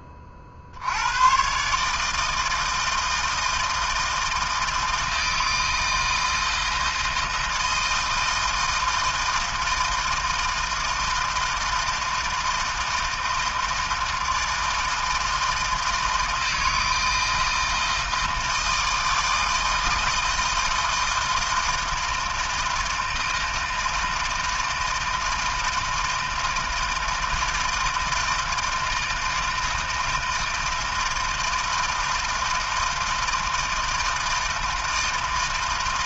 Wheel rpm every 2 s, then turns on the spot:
50, 160, 160, 160, 160, 160, 160, 160, 160, 160, 160, 160, 160, 160, 160, 160, 160, 160.
none